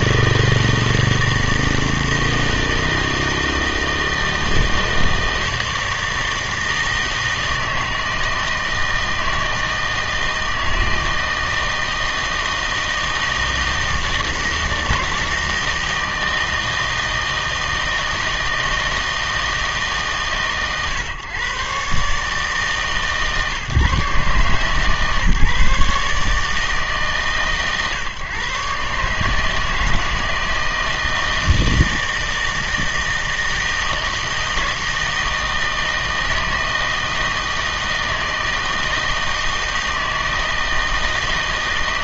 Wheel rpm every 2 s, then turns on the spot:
160, 160, 160, 160, 160, 160, 160, 160, 160, 160, 130, 150, 150, 150, 140, 160, 160, 160, 160, 160, 160.
none